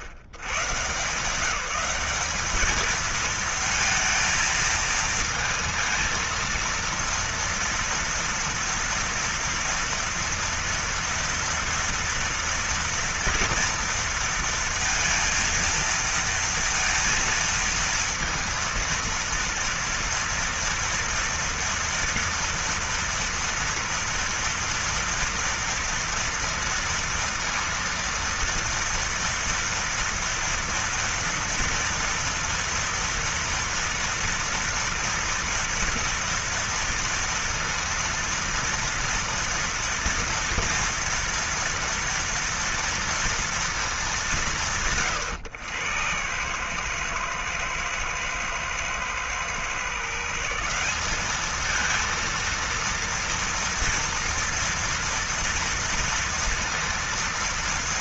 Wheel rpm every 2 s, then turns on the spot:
110, 210, 230, 230, 230, 230, 240, 230, 230, 230, 230, 230, 230, 230, 230, 230, 230, 230, 230, 230, 230, 230, 160, 110, 110, 160, 230, 230, 230.
none